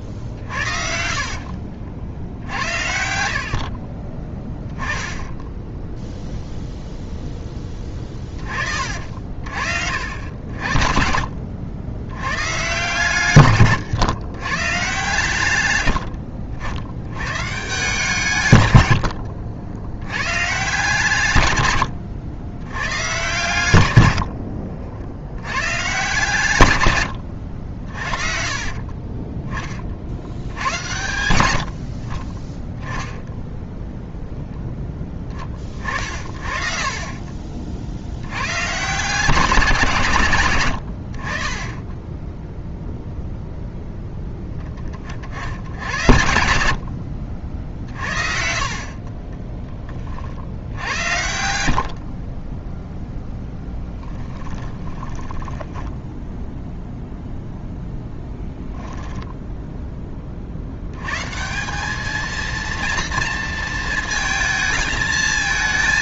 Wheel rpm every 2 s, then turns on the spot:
60, 60, 10, 0, 60, 60, 130, 130, 60, 110, 150, 110, 70, 110, 30, 100, 10, 10, 40, 140, 90, 0, 20, 70, 40, 80, 0, 20, 0, 0, 80, 230, 220.
0-2 28-30 46-48 50-52 54-56